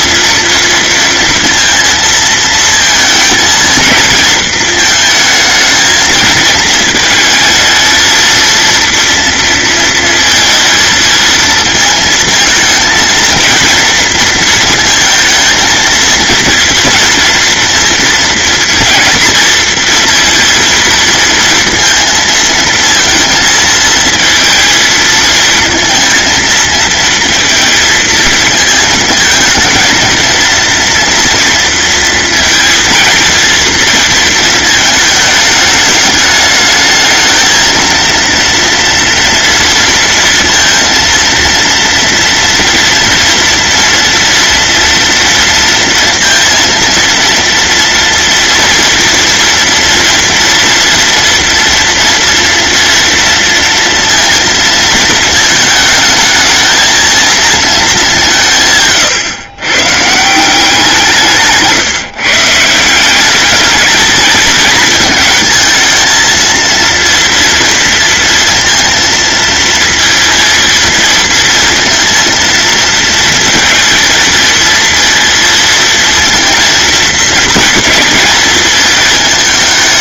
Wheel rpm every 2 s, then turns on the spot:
230, 230, 220, 220, 230, 230, 230, 220, 230, 230, 230, 230, 220, 230, 220, 230, 230, 220, 220, 230, 230, 230, 230, 230, 230, 230, 230, 220, 220, 130, 170, 180, 220, 230, 230, 230, 230, 230, 220, 220.
none